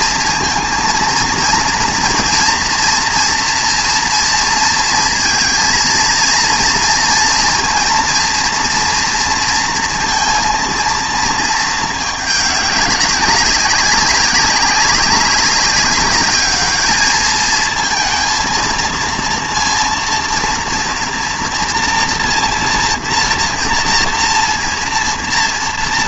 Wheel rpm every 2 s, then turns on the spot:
230, 240, 230, 230, 230, 230, 200, 190, 210, 220, 230, 230, 230.
none